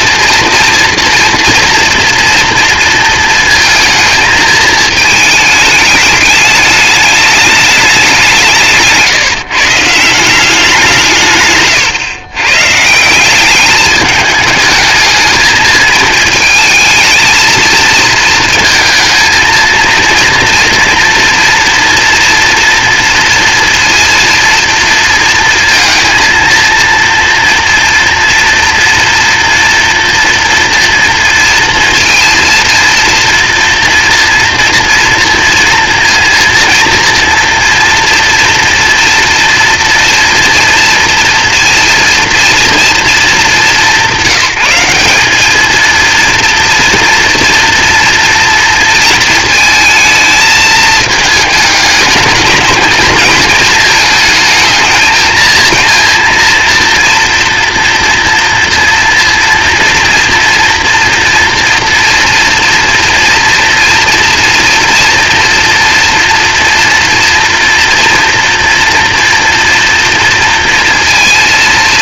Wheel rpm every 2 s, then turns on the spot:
230, 230, 220, 210, 170, 180, 140, 210, 220, 230, 230, 230, 230, 230, 240, 230, 230, 230, 230, 230, 230, 230, 180, 230, 230, 220, 220, 220, 230, 230, 230, 230, 230, 240, 230, 230.
none